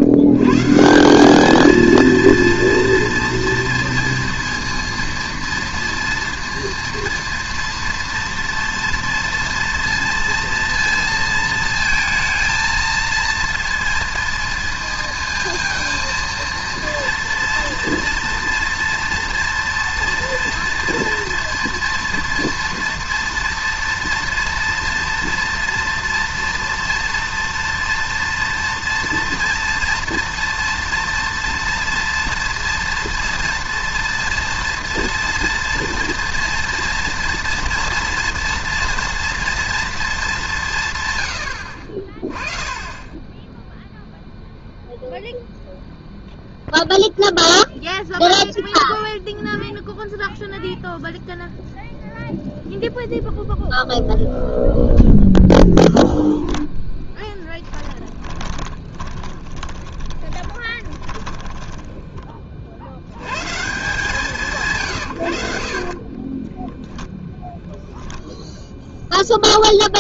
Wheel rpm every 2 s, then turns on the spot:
140, 230, 230, 230, 230, 230, 230, 230, 230, 230, 240, 230, 230, 230, 230, 230, 230, 230, 230, 230, 180, 20, 0, 0, 0, 0, 0, 0, 0, 20, 10, 40, 150, 10, 0.
58-62 66-68